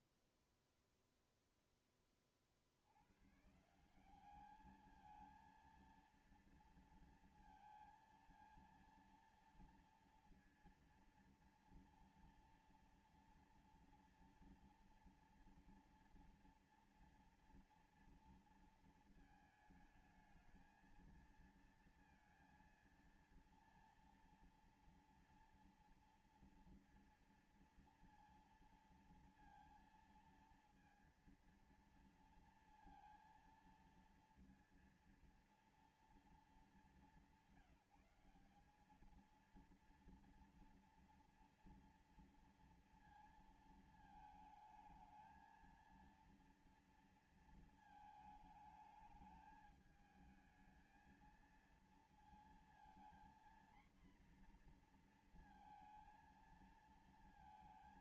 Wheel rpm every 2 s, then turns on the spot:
0, 40, 190, 230, 230, 230, 230, 230, 230, 230, 220, 230, 230, 230, 230, 230, 230, 230, 220, 190, 230, 230, 220, 230, 220, 220, 230, 240, 230.
none